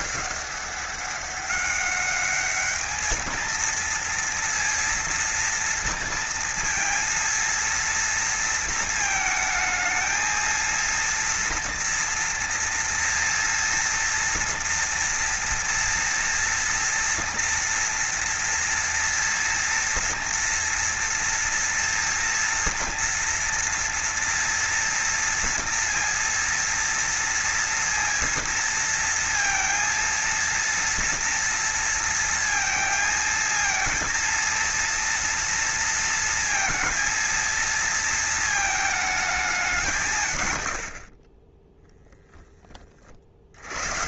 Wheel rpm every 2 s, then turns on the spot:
200, 220, 230, 230, 230, 230, 240, 230, 230, 230, 230, 230, 230, 230, 230, 230, 230, 230, 230, 210, 60, 50.
42-44